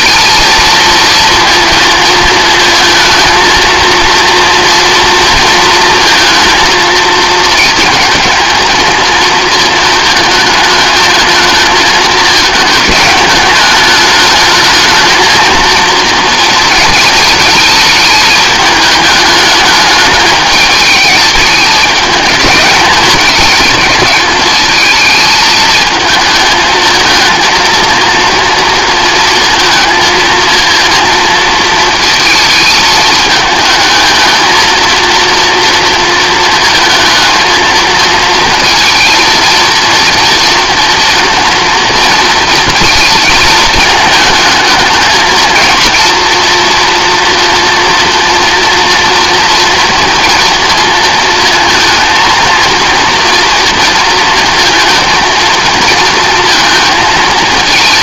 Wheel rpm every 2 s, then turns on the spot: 230, 220, 230, 230, 220, 220, 220, 220, 230, 210, 210, 210, 210, 220, 230, 230, 220, 230, 230, 230, 230, 220, 220, 230, 230, 230, 230, 230, 230.
none